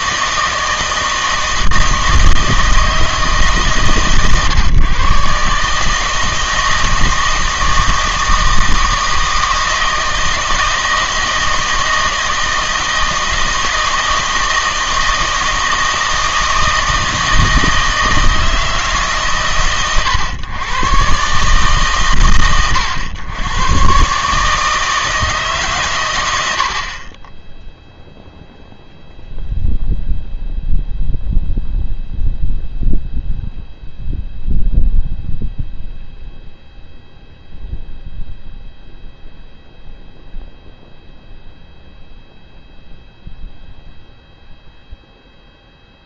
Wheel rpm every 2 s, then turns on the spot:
160, 160, 140, 160, 160, 160, 160, 160, 160, 160, 120, 110, 160, 60, 0, 0, 0, 0, 0, 0, 0, 0, 0.
none